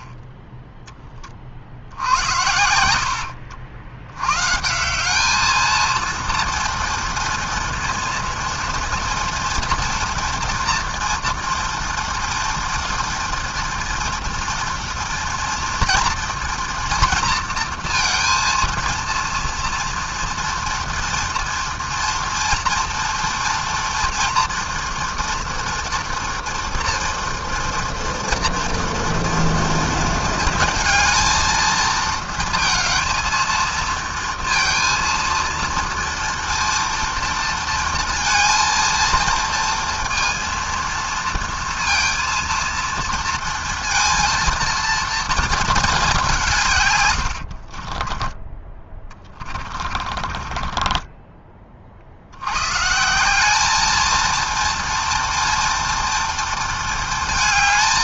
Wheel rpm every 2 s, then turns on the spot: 40, 80, 210, 230, 230, 230, 230, 230, 230, 230, 230, 230, 230, 230, 230, 230, 230, 230, 230, 230, 230, 230, 230, 90, 20, 20, 190, 230, 220.
2-4 46-52